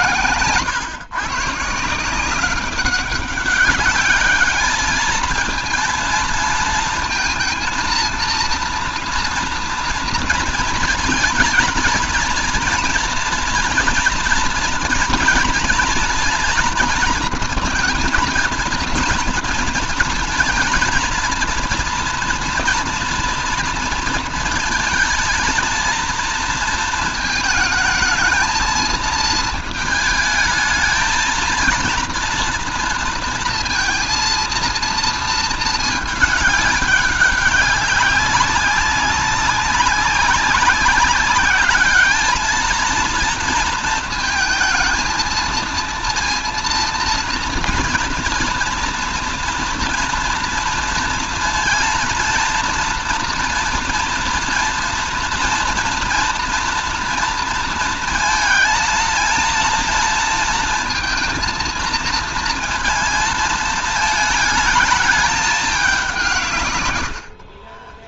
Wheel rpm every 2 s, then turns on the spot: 120, 180, 210, 230, 230, 230, 230, 230, 230, 230, 230, 230, 230, 230, 220, 220, 230, 230, 210, 190, 190, 220, 220, 230, 230, 230, 230, 230, 230, 230, 230, 230, 220, 140.
none